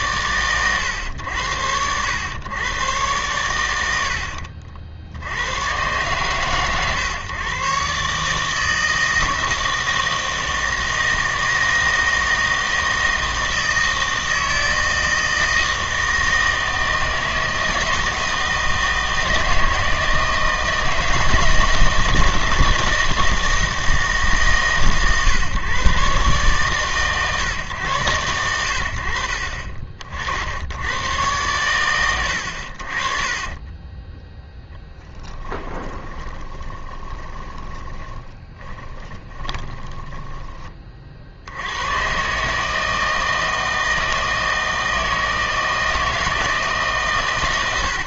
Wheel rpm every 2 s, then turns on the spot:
120, 110, 60, 120, 160, 160, 160, 160, 160, 160, 160, 160, 140, 130, 80, 80, 70, 0, 20, 10, 20, 150, 160, 150.
32-34 36-40